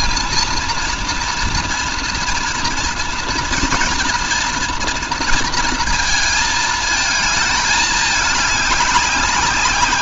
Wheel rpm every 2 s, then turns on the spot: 230, 230, 240, 220, 200.
none